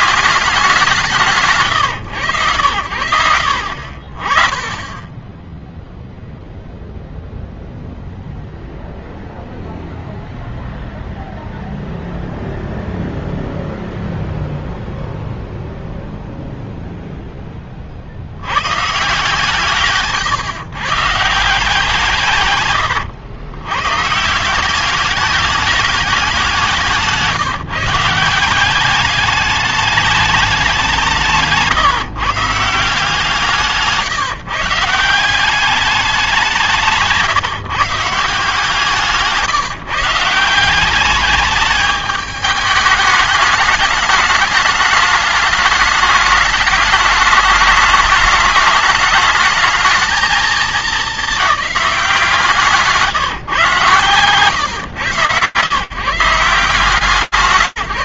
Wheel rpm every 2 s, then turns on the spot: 180, 80, 10, 0, 0, 0, 0, 0, 30, 160, 160, 130, 210, 170, 210, 160, 160, 190, 140, 160, 210, 210, 210, 210, 220, 200, 140, 130, 130.
none